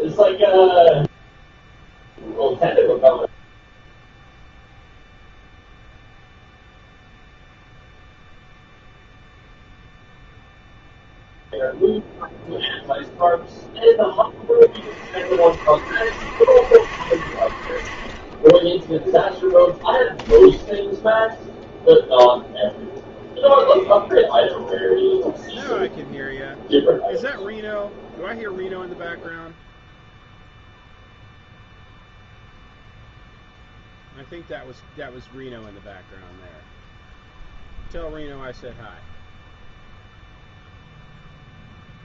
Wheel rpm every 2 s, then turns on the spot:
0, 0, 0, 0, 0, 0, 0, 30, 60, 10, 0, 0, 0, 0, 0, 0, 0, 0, 0, 0, 0.
none